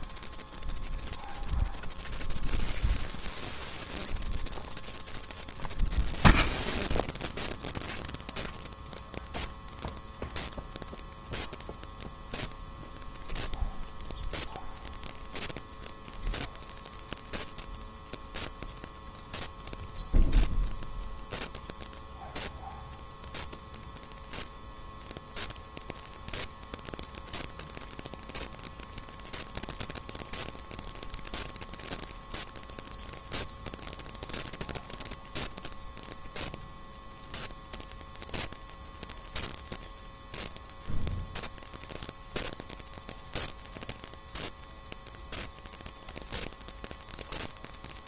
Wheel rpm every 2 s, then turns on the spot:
0, 0, 0, 0, 0, 0, 0, 0, 0, 0, 0, 0, 0, 0, 0, 0, 0, 0, 0, 0, 0, 0, 0, 0.
none